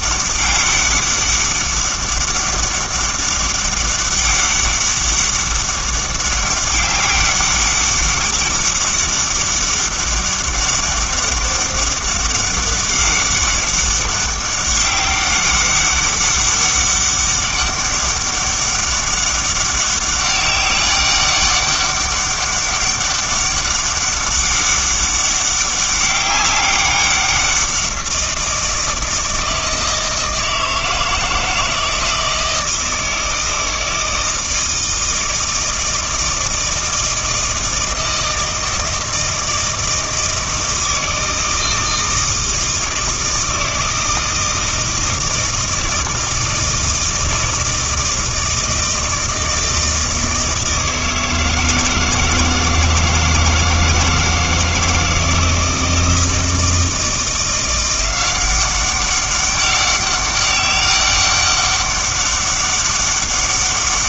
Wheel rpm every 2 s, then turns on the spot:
200, 200, 200, 200, 200, 200, 200, 200, 200, 200, 200, 200, 200, 190, 170, 160, 160, 160, 160, 160, 160, 160, 160, 160, 160, 160, 160, 160, 160, 190, 200, 200.
none